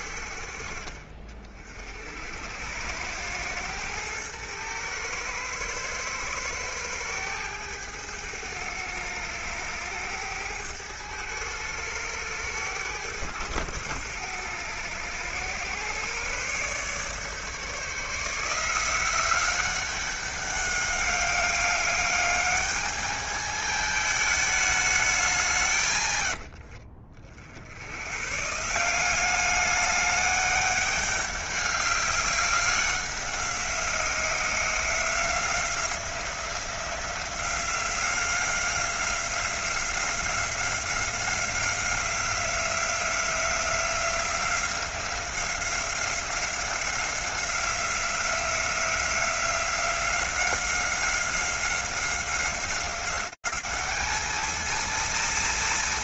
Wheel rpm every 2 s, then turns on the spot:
40, 100, 110, 110, 110, 110, 100, 110, 140, 180, 200, 210, 200, 40, 170, 200, 190, 180, 180, 180, 180, 180, 180, 190, 180, 190, 200, 230.
none